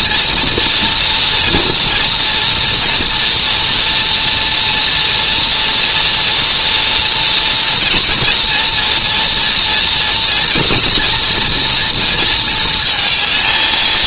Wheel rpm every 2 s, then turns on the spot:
240, 230, 230, 230, 240, 240, 230.
none